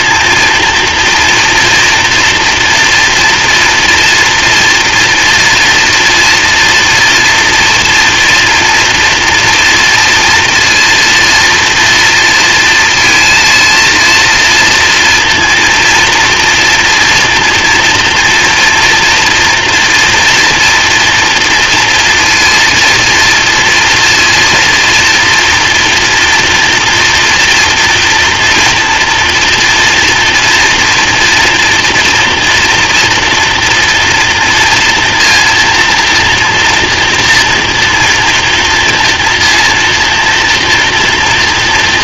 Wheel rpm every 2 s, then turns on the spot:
230, 240, 230, 230, 230, 230, 230, 230, 230, 230, 240, 230, 230, 230, 230, 240, 240, 230, 230, 230, 230.
none